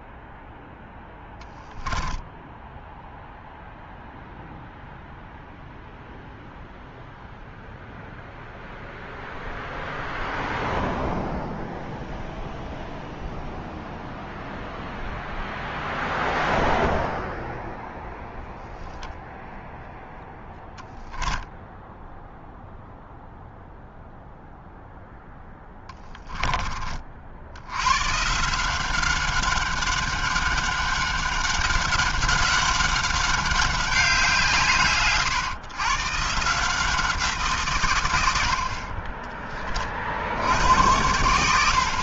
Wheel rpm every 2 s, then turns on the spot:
10, 0, 0, 0, 0, 0, 0, 0, 0, 10, 0, 0, 0, 50, 190, 200, 200, 140, 170, 30, 90.
0-2